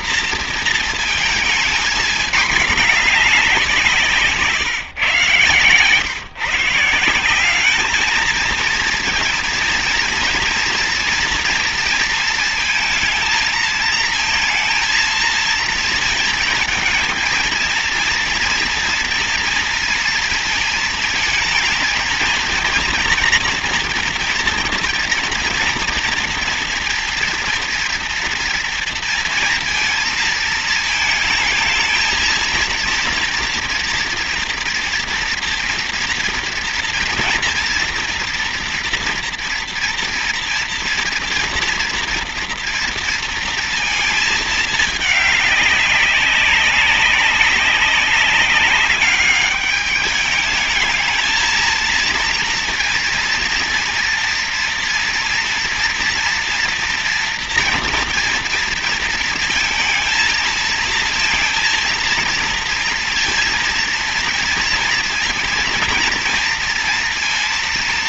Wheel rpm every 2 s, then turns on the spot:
220, 210, 130, 170, 230, 230, 230, 230, 230, 230, 230, 230, 230, 230, 230, 220, 230, 230, 230, 230, 230, 230, 210, 200, 200, 220, 230, 230, 230, 230, 230, 230, 230, 230.
none